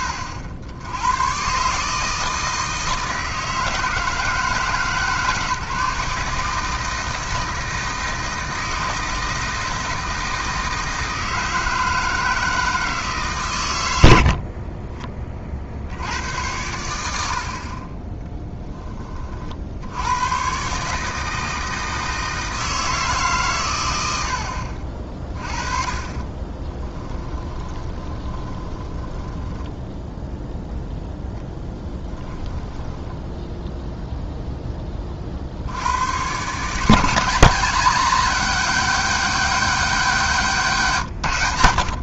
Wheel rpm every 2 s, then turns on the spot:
90, 160, 150, 160, 160, 160, 160, 30, 90, 10, 140, 160, 50, 20, 20, 0, 10, 10, 150, 200, 160.
14-16 26-30 32-34 40-42